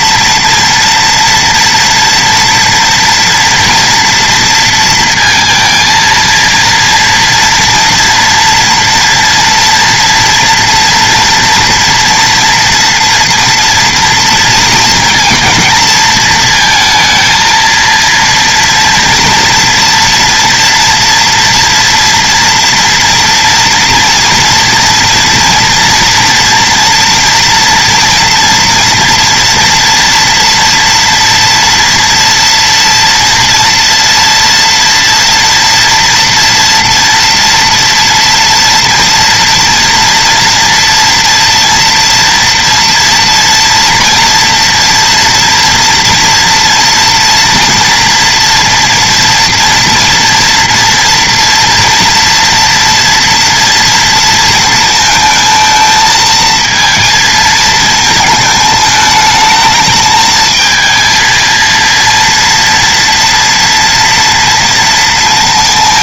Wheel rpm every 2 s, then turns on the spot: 230, 230, 230, 230, 240, 230, 240, 230, 220, 230, 230, 230, 230, 230, 240, 240, 230, 230, 240, 230, 230, 230, 240, 230, 240, 230, 230, 220, 230, 220, 220, 230, 230.
none